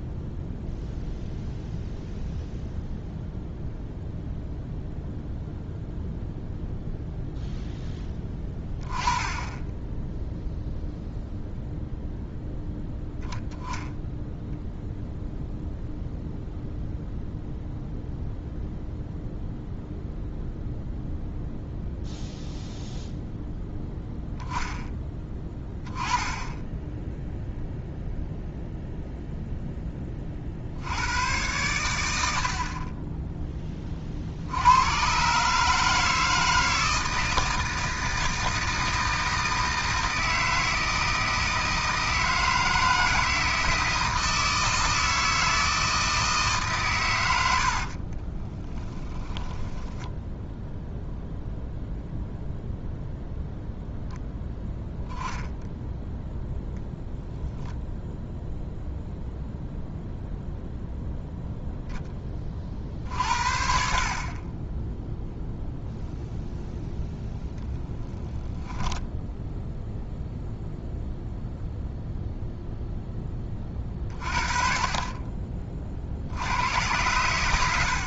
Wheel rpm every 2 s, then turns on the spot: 0, 0, 0, 0, 20, 0, 0, 0, 0, 0, 0, 0, 10, 10, 0, 70, 40, 90, 160, 160, 160, 160, 160, 140, 10, 0, 0, 0, 10, 0, 0, 40, 10, 0, 10, 0, 0, 30, 90.
48-50